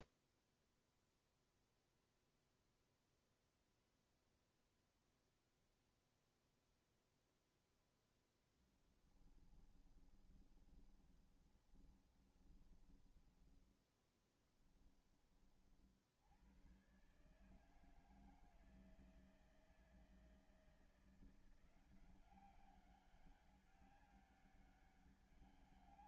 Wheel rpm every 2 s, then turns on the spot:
0, 0, 0, 0, 10, 20, 20, 10, 90, 160, 160, 190, 200.
10-14